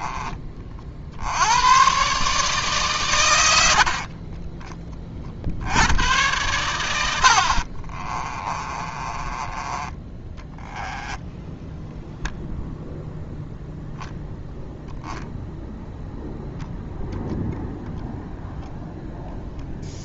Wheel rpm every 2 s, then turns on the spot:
40, 140, 20, 100, 30, 10, 0, 0, 0, 0.
8-12